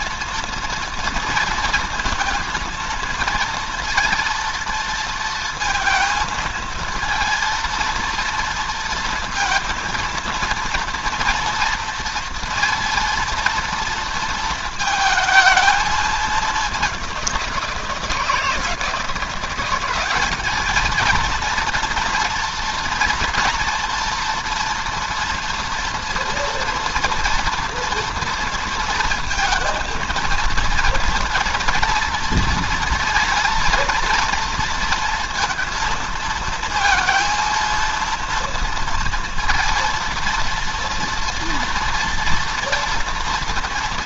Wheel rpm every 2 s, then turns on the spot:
230, 230, 230, 230, 230, 230, 230, 230, 200, 170, 220, 230, 230, 230, 230, 230, 230, 230, 230, 230, 230, 230.
none